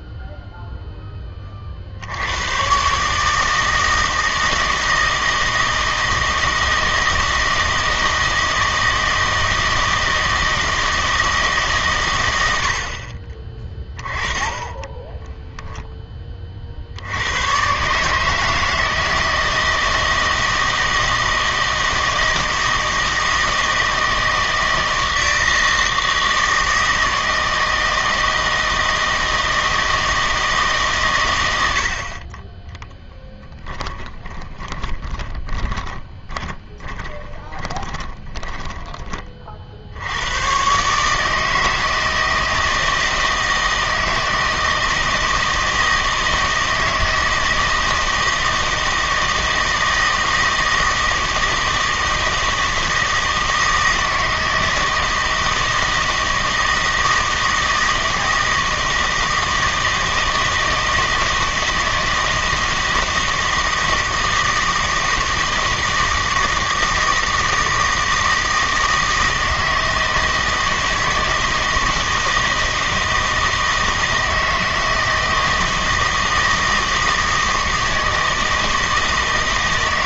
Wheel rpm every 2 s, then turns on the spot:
0, 120, 160, 160, 160, 160, 80, 20, 50, 160, 160, 160, 160, 160, 160, 150, 10, 20, 10, 10, 130, 160, 160, 160, 160, 160, 160, 160, 160, 160, 160, 160, 160, 160, 160, 160, 160, 160, 160, 160.
14-16 34-38